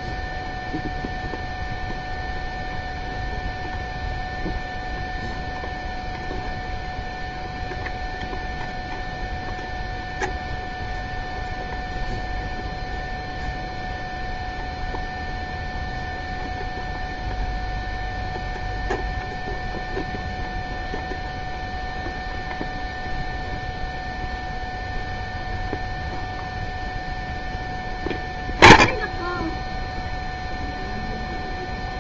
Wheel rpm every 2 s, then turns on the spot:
0, 0, 0, 0, 0, 0, 0, 0, 0, 0, 0, 0, 0, 0, 0, 0.
none